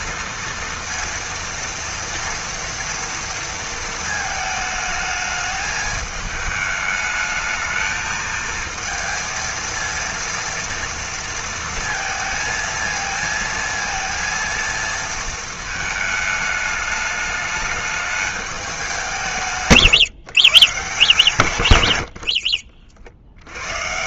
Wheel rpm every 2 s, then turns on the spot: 230, 230, 220, 210, 230, 230, 230, 230, 210, 210, 160, 50.
22-24